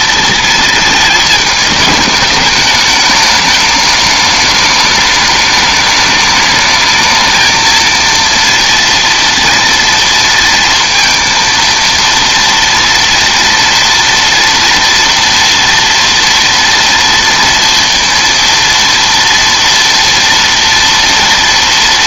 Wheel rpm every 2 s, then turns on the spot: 220, 210, 210, 210, 230, 230, 230, 230, 230, 230, 230.
none